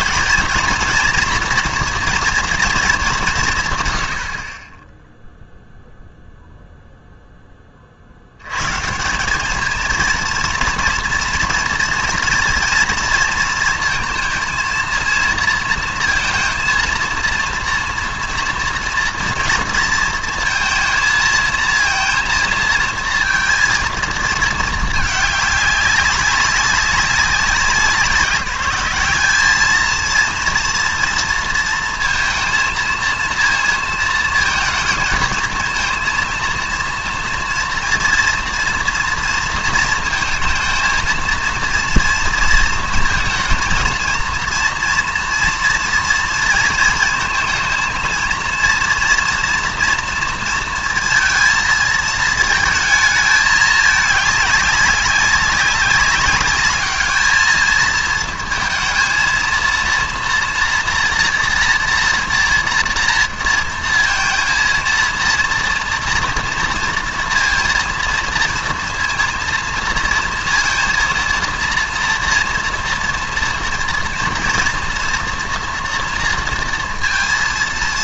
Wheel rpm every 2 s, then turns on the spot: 230, 230, 30, 0, 120, 230, 230, 230, 230, 230, 230, 220, 220, 190, 180, 230, 230, 230, 230, 230, 230, 230, 230, 230, 230, 230, 220, 200, 210, 230, 230, 240, 230, 230, 230, 230, 230, 230, 230.
none